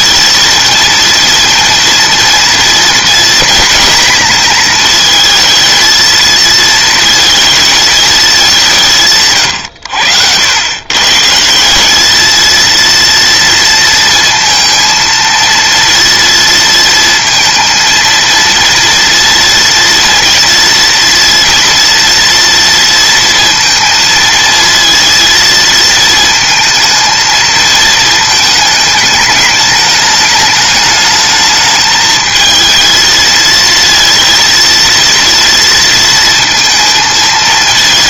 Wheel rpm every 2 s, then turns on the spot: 230, 240, 220, 230, 160, 130, 230, 230, 230, 230, 230, 230, 230, 220, 210, 210, 220, 230, 220.
none